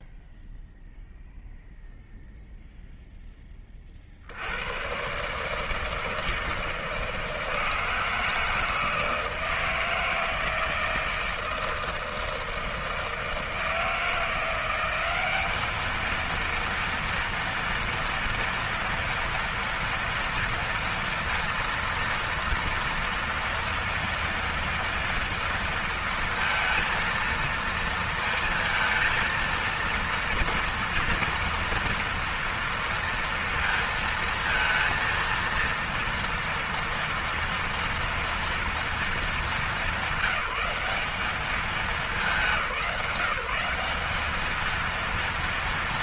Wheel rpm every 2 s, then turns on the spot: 0, 0, 50, 160, 160, 160, 160, 160, 220, 240, 230, 230, 230, 230, 230, 230, 230, 230, 230, 230, 190, 200, 200.
none